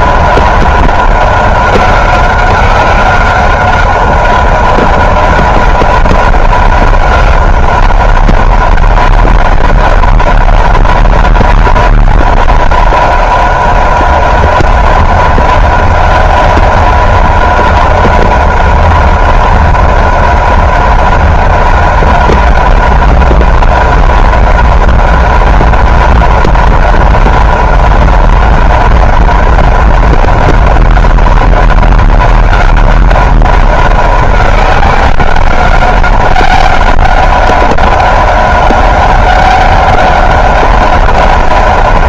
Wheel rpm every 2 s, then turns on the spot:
190, 190, 190, 190, 190, 190, 190, 190, 190, 190, 190, 190, 190, 190, 190, 190, 190, 190, 190, 190, 190.
none